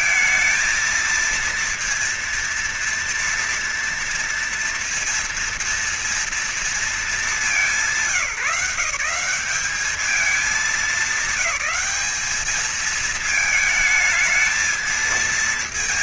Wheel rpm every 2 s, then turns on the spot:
230, 230, 230, 230, 180, 210, 210, 220.
none